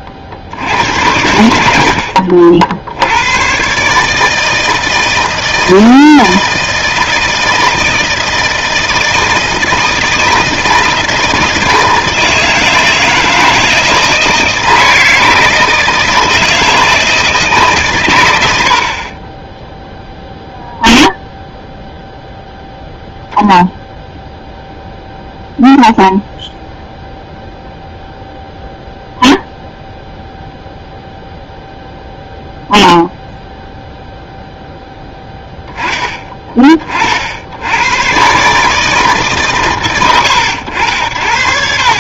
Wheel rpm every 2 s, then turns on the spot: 80, 60, 160, 160, 160, 160, 160, 160, 160, 80, 0, 0, 0, 0, 0, 0, 0, 0, 30, 150, 90.
none